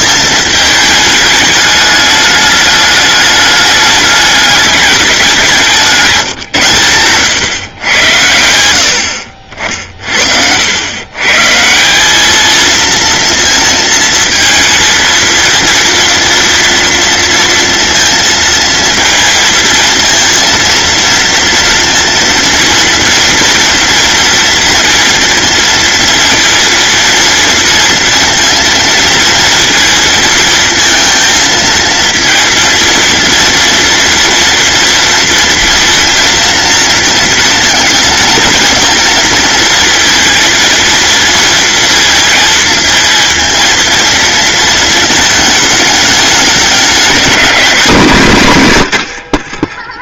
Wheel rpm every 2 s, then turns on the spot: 220, 220, 200, 120, 80, 110, 230, 230, 230, 230, 230, 230, 230, 230, 230, 230, 230, 230, 230, 230, 230, 230, 220, 200, 120.
none